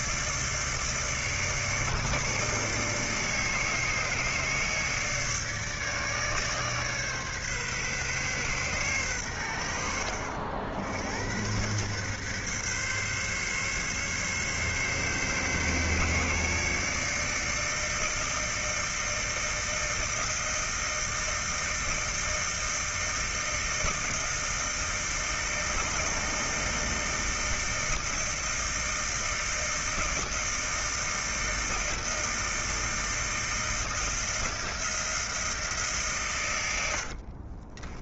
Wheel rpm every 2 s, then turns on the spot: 150, 150, 150, 140, 120, 80, 140, 140, 150, 160, 160, 160, 160, 160, 160, 160, 160, 160, 80.
36-38